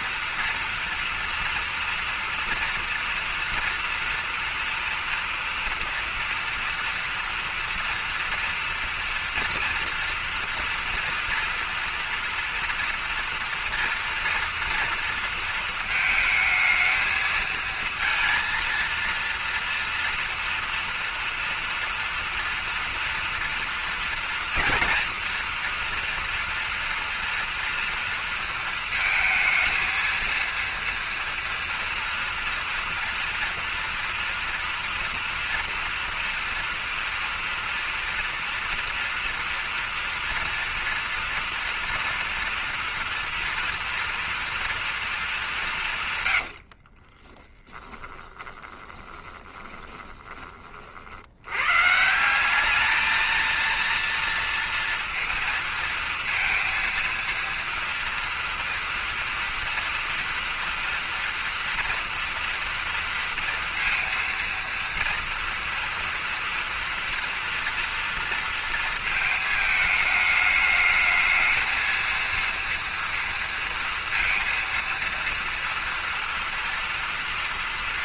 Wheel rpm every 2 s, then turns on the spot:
230, 230, 230, 230, 230, 230, 240, 230, 220, 230, 230, 230, 230, 230, 230, 230, 230, 230, 230, 230, 230, 230, 230, 80, 10, 30, 200, 230, 230, 230, 230, 230, 230, 240, 230, 210, 230, 230, 230.
46-50